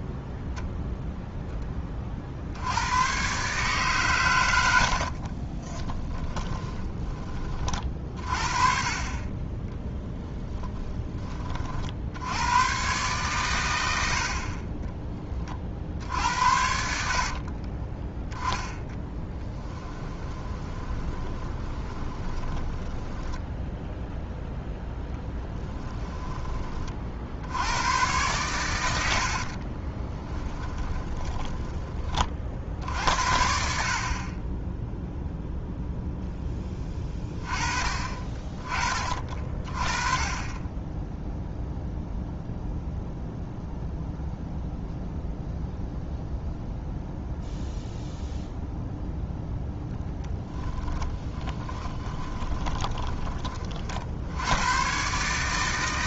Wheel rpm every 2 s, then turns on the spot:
0, 90, 70, 20, 40, 20, 120, 30, 80, 10, 20, 20, 0, 30, 100, 20, 70, 10, 10, 30, 30, 0, 0, 0, 0, 10, 20, 120.
6-8 10-12 20-24 30-32 50-54